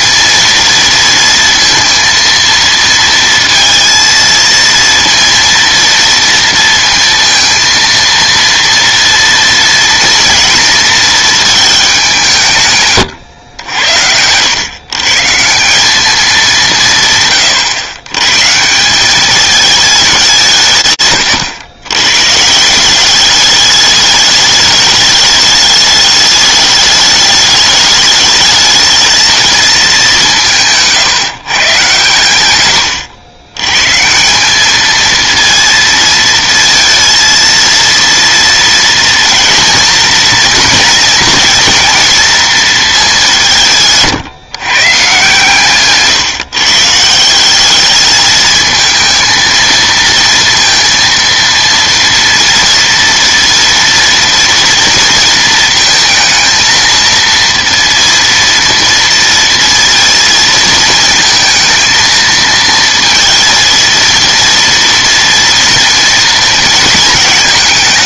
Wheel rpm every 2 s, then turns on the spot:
230, 230, 230, 230, 230, 230, 140, 120, 170, 170, 140, 180, 210, 210, 220, 160, 110, 220, 230, 230, 230, 220, 140, 160, 220, 230, 230, 230, 230, 230, 220, 230, 230, 220.
32-34